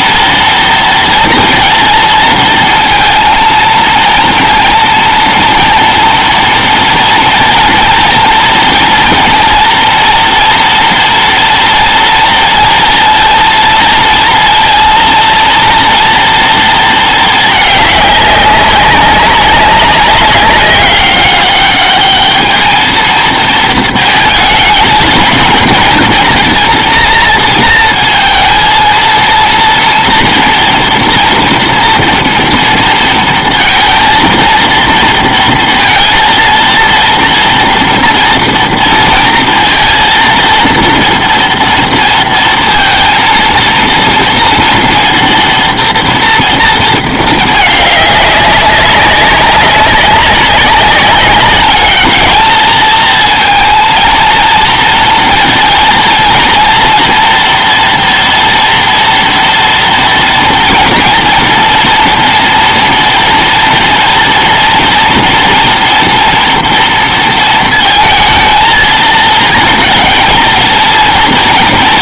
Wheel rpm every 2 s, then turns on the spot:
230, 230, 230, 230, 230, 230, 230, 230, 230, 200, 190, 220, 220, 230, 230, 230, 230, 230, 230, 230, 230, 230, 230, 230, 200, 190, 220, 230, 230, 230, 240, 230, 230, 230, 220, 230.
none